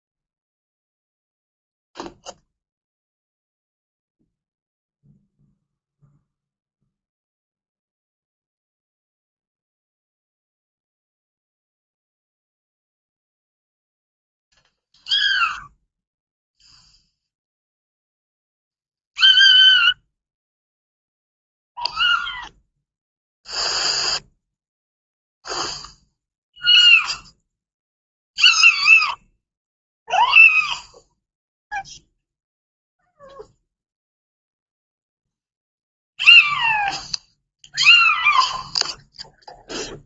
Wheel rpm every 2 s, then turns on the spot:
0, 0, 0, 0, 0, 0, 0, 0, 0, 0, 0, 0, 0, 0, 0, 0, 0, 0, 0, 0.
none